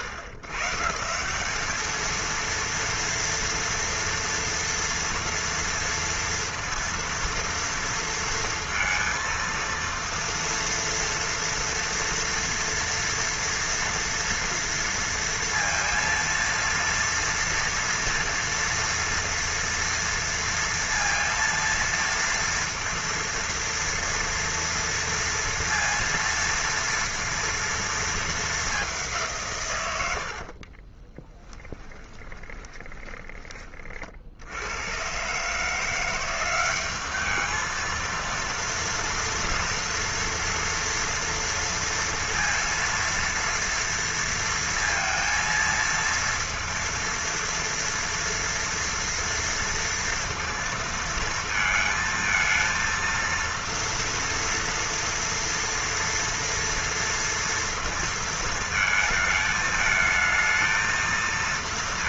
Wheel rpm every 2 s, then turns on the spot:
150, 230, 230, 230, 230, 230, 230, 230, 230, 230, 230, 230, 230, 230, 210, 50, 20, 90, 190, 230, 240, 230, 230, 230, 230, 230, 230, 230, 230, 220, 220.
30-34